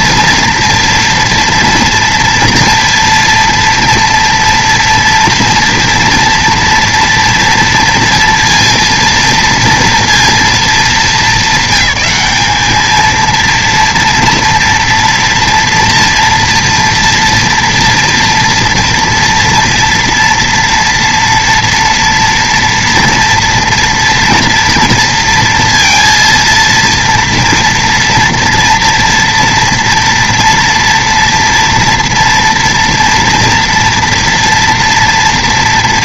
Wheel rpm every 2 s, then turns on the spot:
230, 230, 230, 230, 230, 220, 210, 230, 230, 230, 230, 230, 230, 230, 230, 230, 230, 230.
none